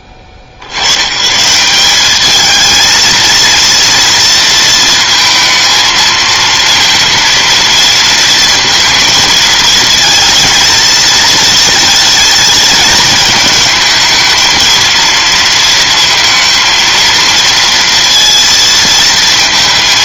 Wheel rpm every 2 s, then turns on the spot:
80, 220, 220, 230, 230, 230, 220, 230, 230, 230.
none